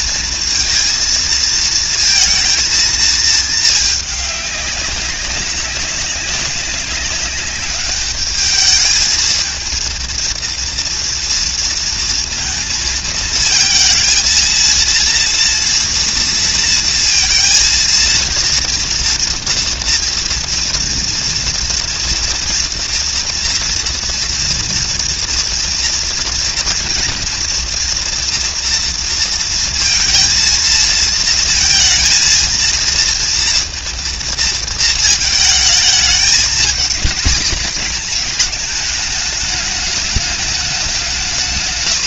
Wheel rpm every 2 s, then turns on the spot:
230, 220, 200, 210, 220, 230, 230, 230, 230, 230, 230, 230, 240, 230, 230, 230, 230, 220, 230, 220, 190.
none